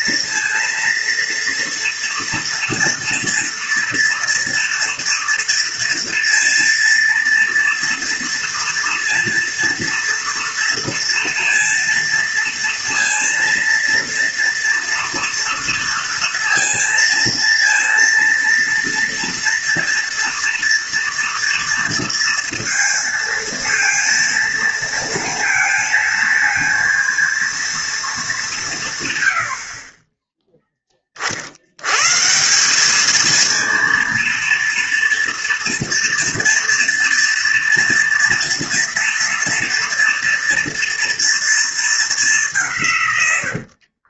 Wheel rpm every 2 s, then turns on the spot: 230, 230, 230, 230, 230, 230, 230, 230, 230, 230, 230, 230, 230, 230, 170, 10, 190, 230, 230, 230, 230, 160.
none